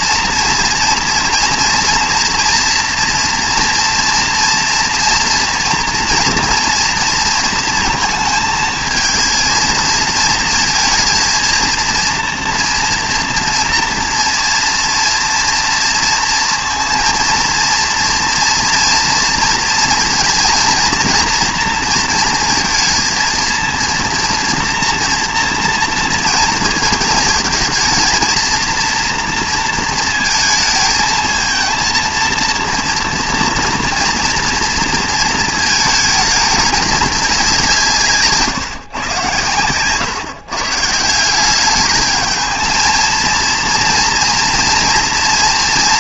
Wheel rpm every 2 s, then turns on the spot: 230, 240, 230, 230, 220, 230, 230, 230, 230, 230, 240, 230, 240, 220, 230, 220, 230, 230, 210, 140, 140, 220, 240.
none